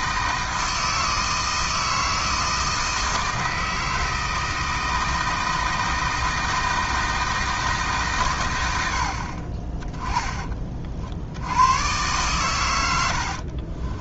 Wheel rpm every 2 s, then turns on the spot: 160, 160, 160, 160, 80, 40, 90.
none